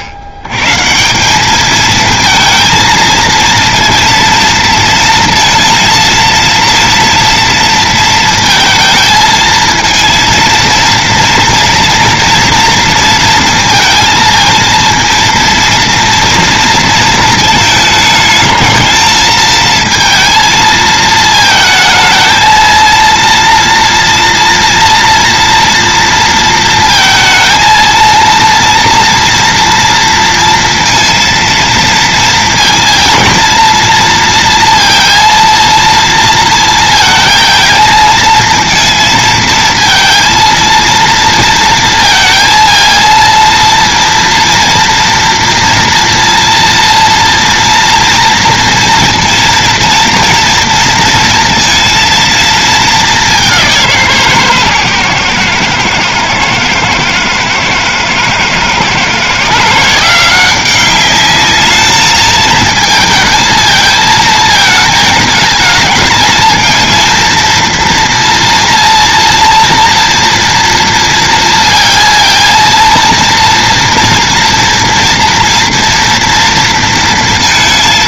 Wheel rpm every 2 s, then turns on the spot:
80, 230, 230, 230, 230, 230, 230, 230, 230, 220, 220, 230, 230, 230, 230, 230, 230, 230, 230, 220, 230, 230, 230, 230, 230, 230, 220, 140, 110, 120, 190, 220, 220, 220, 230, 230, 230, 230, 230.
none